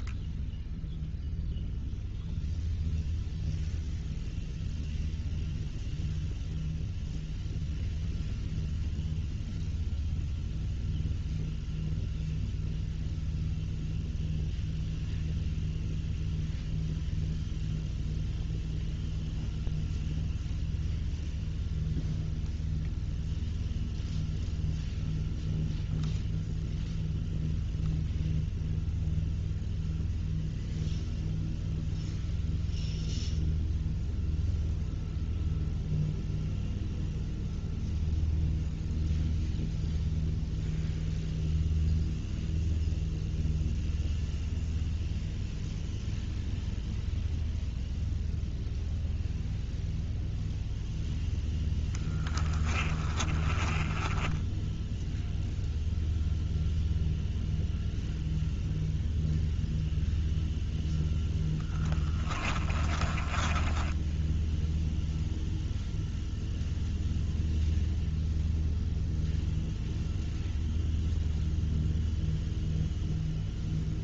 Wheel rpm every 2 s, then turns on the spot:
10, 0, 0, 0, 0, 0, 0, 0, 0, 0, 0, 0, 0, 0, 0, 0, 0, 0, 0, 0, 0, 0, 0, 0, 0, 0, 30, 0, 0, 0, 0, 20, 0, 0, 0, 0, 0.
52-54 62-64